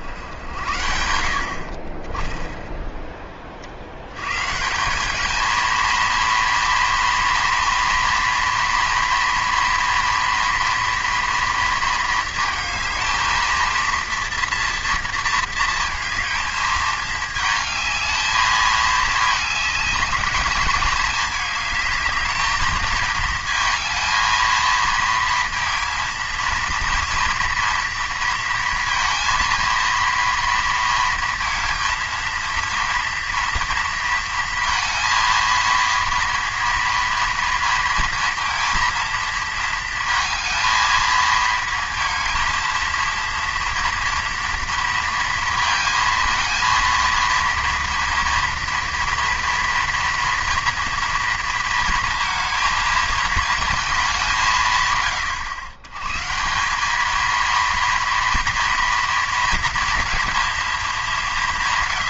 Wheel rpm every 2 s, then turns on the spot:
70, 10, 160, 230, 230, 230, 220, 230, 220, 220, 220, 220, 220, 230, 230, 230, 230, 230, 230, 230, 230, 230, 230, 230, 230, 240, 220, 150, 190, 230, 210.
none